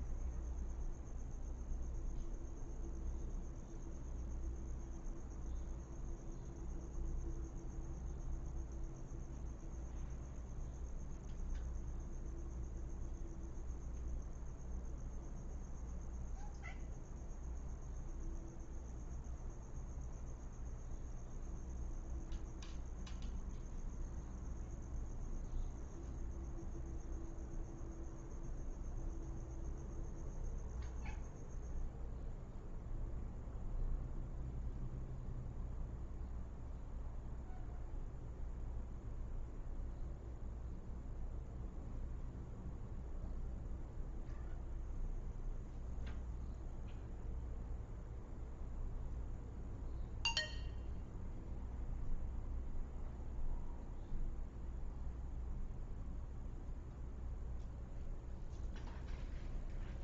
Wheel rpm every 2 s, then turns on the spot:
0, 0, 0, 0, 0, 0, 0, 0, 0, 0, 0, 0, 0, 0, 0, 0, 0, 0, 0, 0, 0, 0, 0, 0, 0, 0, 0, 0, 0, 0.
none